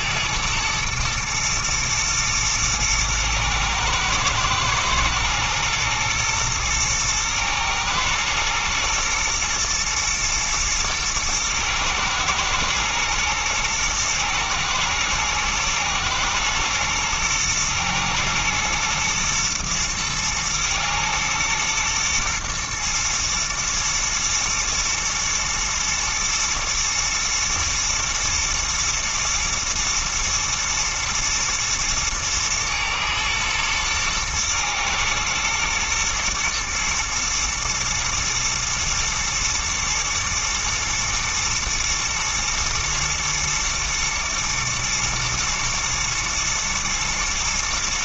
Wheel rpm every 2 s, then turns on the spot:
110, 110, 110, 110, 120, 110, 120, 120, 120, 110, 120, 110, 110, 120, 110, 120, 120, 120, 120, 120, 110, 120, 120, 110.
none